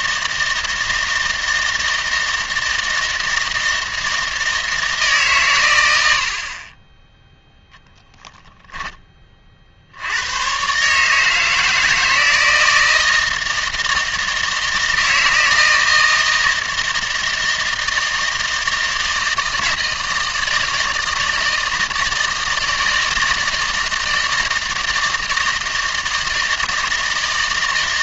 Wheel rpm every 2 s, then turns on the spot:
160, 160, 160, 20, 10, 130, 160, 160, 160, 160, 160, 160, 160, 160.
none